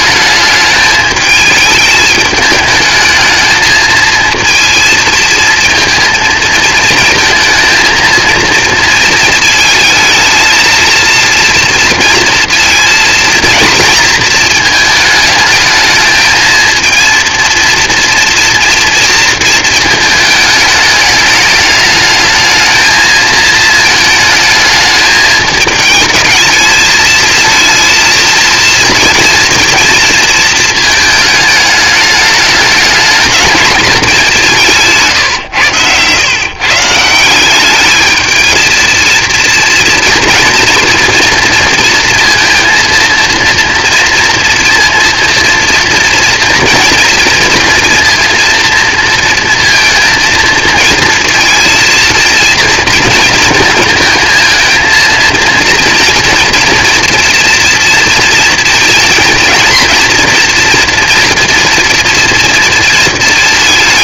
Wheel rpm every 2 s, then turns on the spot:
210, 220, 230, 230, 230, 230, 230, 220, 230, 230, 210, 220, 220, 220, 230, 220, 210, 140, 160, 230, 230, 230, 230, 230, 230, 230, 230, 230, 230, 230, 230, 230.
none